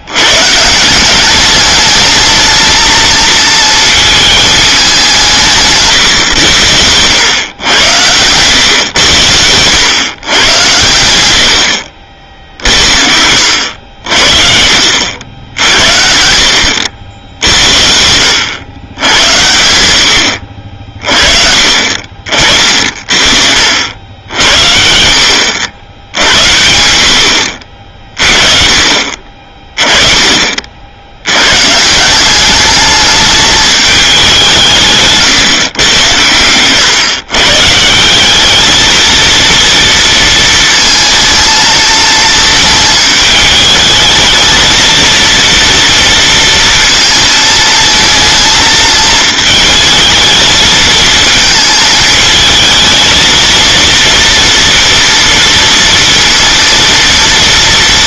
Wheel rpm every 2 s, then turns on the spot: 160, 220, 200, 90, 120, 110, 60, 70, 70, 90, 50, 50, 60, 80, 50, 50, 210, 180, 120, 220, 220, 220, 220, 230, 220, 220, 220, 240, 230.
none